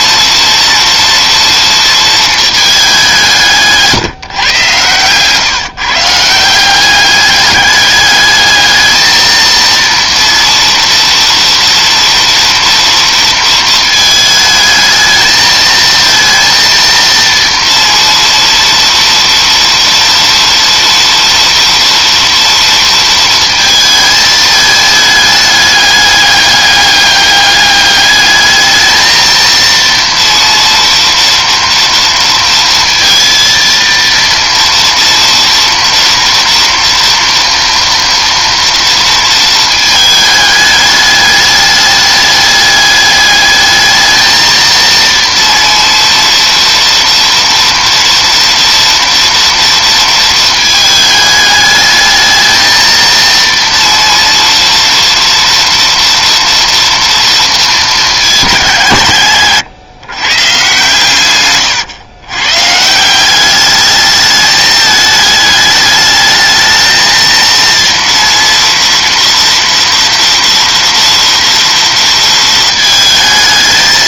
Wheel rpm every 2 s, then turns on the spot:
230, 220, 130, 170, 220, 230, 230, 220, 230, 230, 230, 230, 220, 200, 210, 230, 230, 230, 240, 230, 210, 210, 230, 230, 230, 220, 220, 230, 230, 190, 130, 140, 210, 220, 230, 230, 220.
none